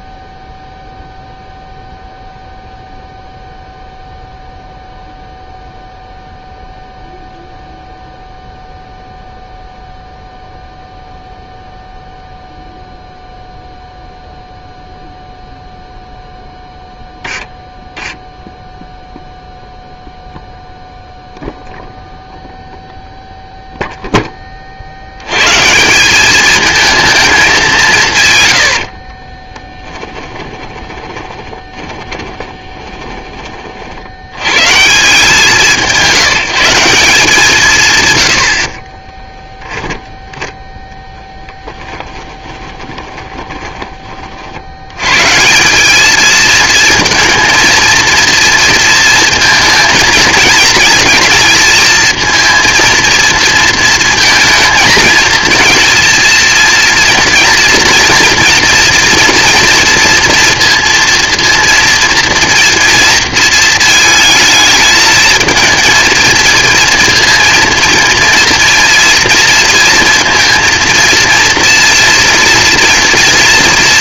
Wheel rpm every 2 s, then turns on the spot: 0, 0, 0, 0, 0, 0, 0, 0, 0, 0, 0, 0, 30, 210, 90, 20, 20, 130, 170, 70, 10, 20, 60, 220, 230, 230, 230, 230, 230, 230, 230, 230, 220, 230, 230, 230, 230.
28-34 42-44